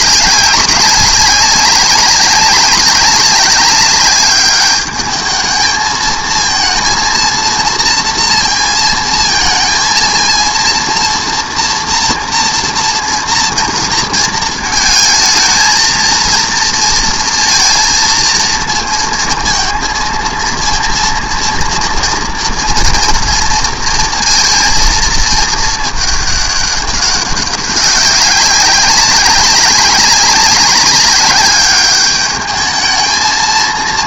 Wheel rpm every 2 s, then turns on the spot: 200, 200, 220, 230, 230, 230, 230, 230, 230, 230, 230, 230, 220, 200, 200, 210, 230.
none